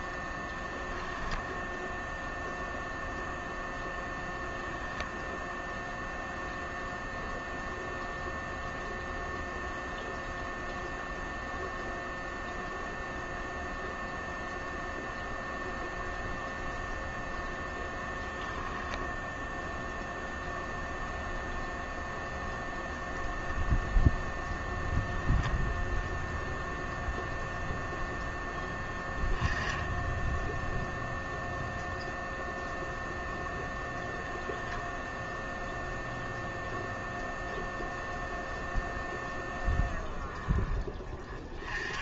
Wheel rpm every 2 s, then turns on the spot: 0, 0, 0, 0, 0, 0, 0, 0, 0, 0, 0, 0, 0, 0, 10, 0, 0, 0, 0, 0, 10.
none